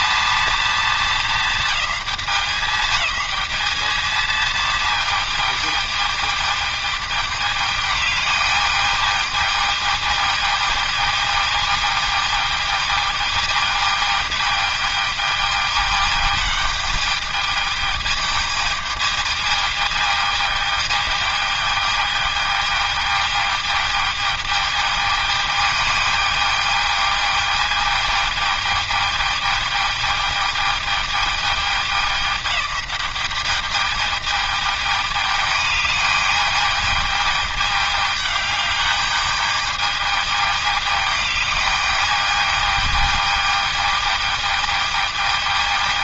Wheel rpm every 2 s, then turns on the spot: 230, 210, 220, 210, 210, 220, 220, 220, 210, 220, 220, 220, 220, 220, 220, 220, 200, 210, 210, 210, 210, 220, 220.
none